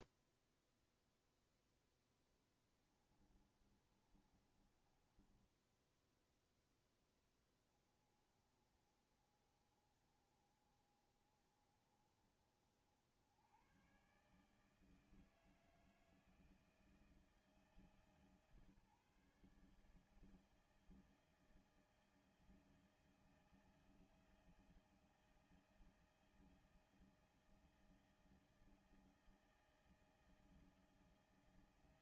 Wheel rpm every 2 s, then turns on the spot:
0, 10, 30, 10, 30, 30, 30, 130, 160, 150, 150, 160, 160, 160, 160, 160.
2-6